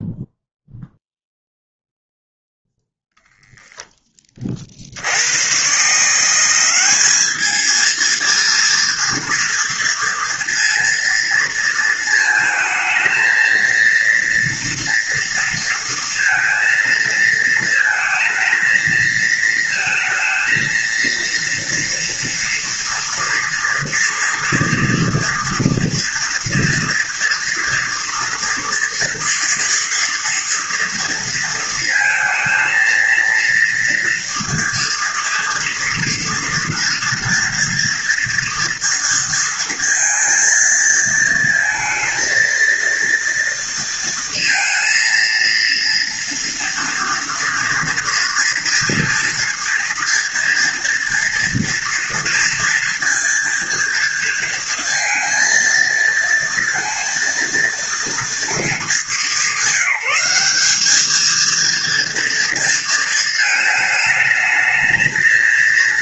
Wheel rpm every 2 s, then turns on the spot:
0, 0, 80, 210, 230, 230, 230, 230, 220, 220, 230, 240, 230, 230, 240, 230, 230, 230, 240, 230, 220, 230, 230, 230, 230, 230, 230, 230, 230, 220, 220, 230, 220.
none